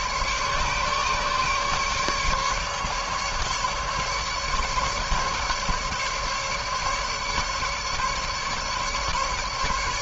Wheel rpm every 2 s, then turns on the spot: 150, 150, 150, 150, 150.
none